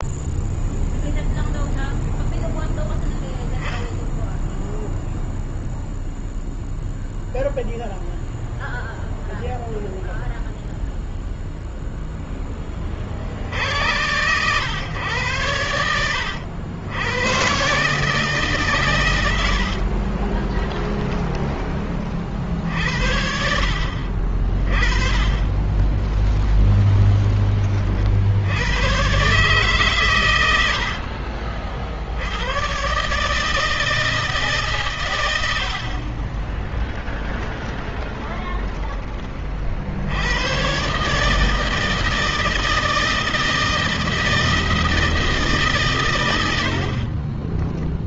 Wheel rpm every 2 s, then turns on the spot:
0, 0, 0, 0, 0, 0, 40, 120, 100, 120, 20, 70, 30, 20, 120, 70, 130, 120, 10, 20, 130, 160, 160, 50.
18-22 24-26 30-32 36-38